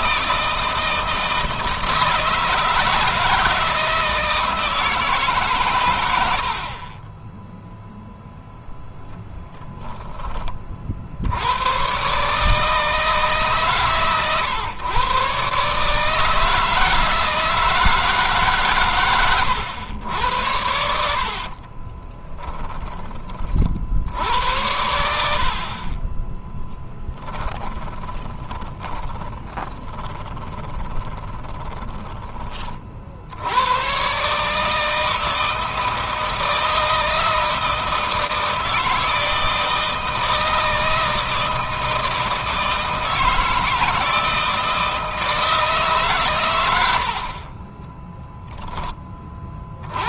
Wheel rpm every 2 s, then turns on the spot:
160, 160, 160, 40, 10, 60, 160, 120, 160, 120, 80, 10, 80, 10, 30, 20, 50, 160, 160, 160, 160, 160, 160, 90, 20.
20-22 26-32